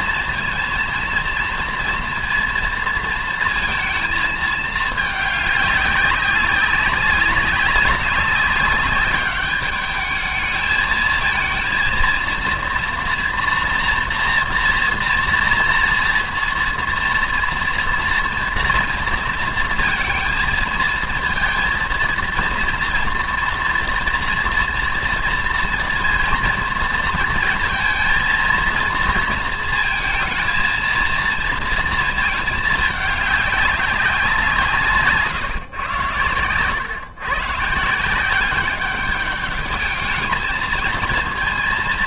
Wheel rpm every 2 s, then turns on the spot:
230, 230, 210, 200, 200, 220, 240, 240, 230, 230, 220, 230, 230, 230, 230, 230, 210, 150, 130, 200, 230.
none